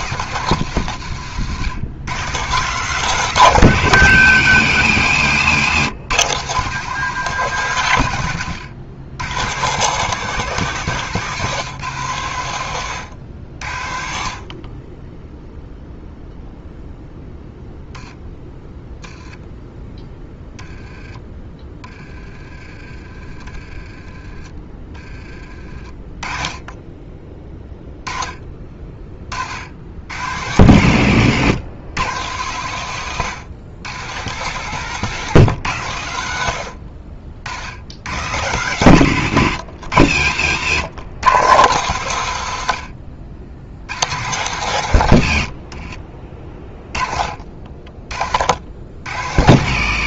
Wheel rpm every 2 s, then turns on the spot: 150, 150, 120, 150, 110, 160, 110, 30, 0, 10, 10, 30, 20, 20, 30, 100, 120, 140, 70, 120, 110, 90, 110, 20, 90.
36-38 42-44